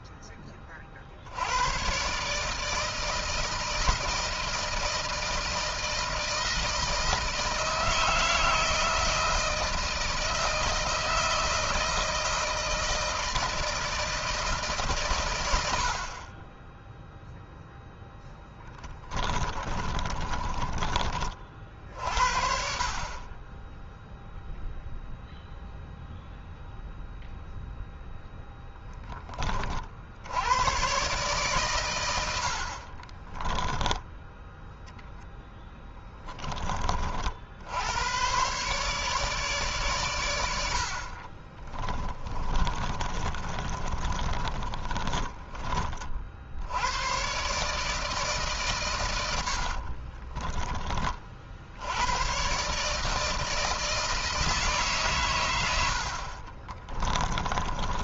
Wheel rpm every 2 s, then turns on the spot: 60, 160, 160, 160, 160, 160, 160, 140, 10, 20, 30, 40, 0, 0, 10, 120, 30, 10, 50, 140, 60, 30, 30, 100, 120, 40, 150, 140, 20.
18-20 32-34 40-46 48-50 56-58